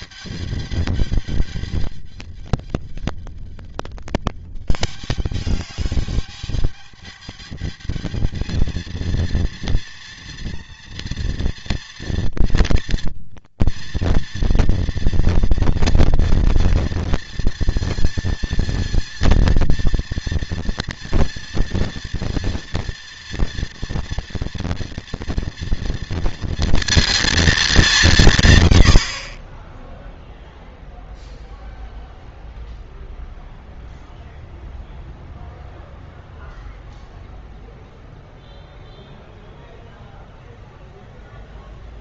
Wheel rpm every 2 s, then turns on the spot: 210, 210, 210, 210, 230, 230, 240, 230, 230, 230, 230, 230, 230, 230, 60, 0, 0, 0, 0, 0, 0.
none